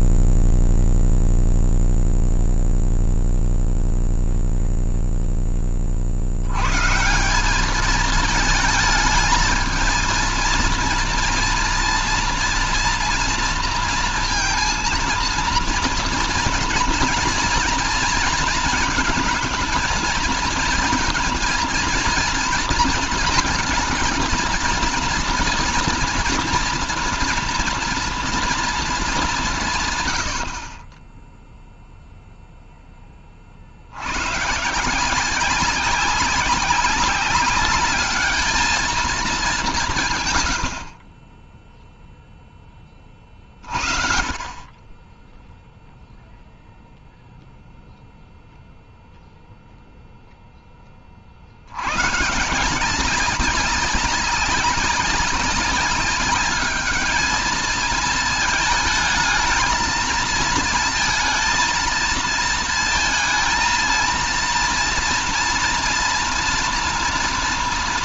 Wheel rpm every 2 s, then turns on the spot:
0, 0, 120, 220, 230, 230, 230, 230, 220, 230, 230, 230, 230, 230, 50, 0, 140, 190, 210, 80, 10, 50, 0, 0, 0, 120, 190, 200, 220, 220, 230, 230, 240, 230.
none